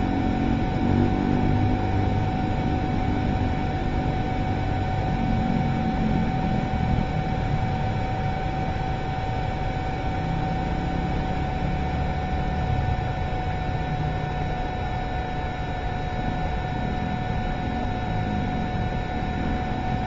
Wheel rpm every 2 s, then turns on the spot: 0, 0, 0, 0, 0, 0, 0, 0, 0, 0.
none